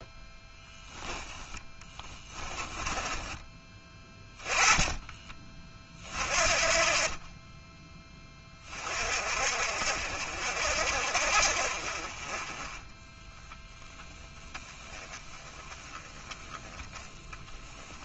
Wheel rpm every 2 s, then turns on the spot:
10, 20, 20, 40, 40, 50, 10, 10, 20.
2-4